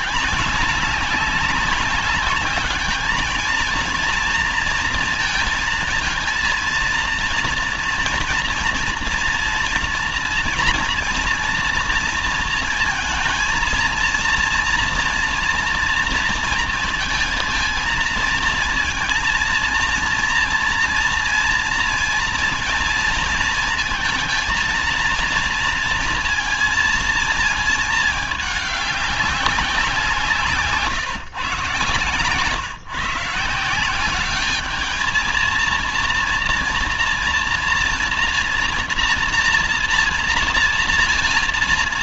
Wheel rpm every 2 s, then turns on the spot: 190, 210, 230, 230, 230, 230, 230, 230, 230, 230, 230, 230, 230, 230, 210, 150, 130, 210, 230, 230, 230.
none